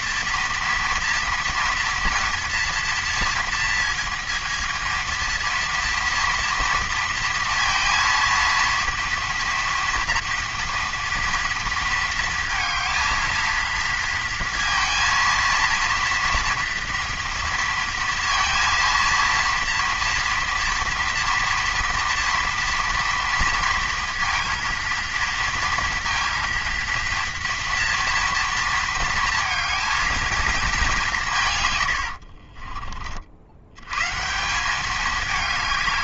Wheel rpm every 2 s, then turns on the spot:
230, 230, 230, 230, 230, 230, 230, 230, 230, 230, 240, 230, 230, 230, 230, 200, 40, 200.
none